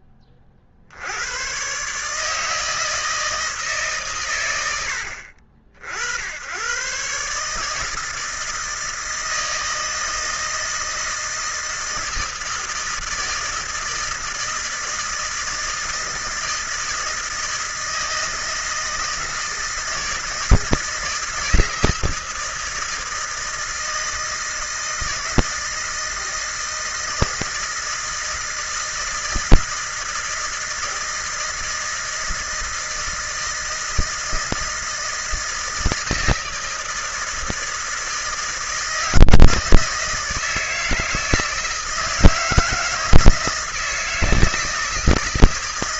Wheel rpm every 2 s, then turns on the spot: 50, 160, 70, 110, 160, 160, 160, 160, 160, 160, 160, 160, 160, 160, 160, 160, 160, 160, 160, 160, 160, 160, 160.
none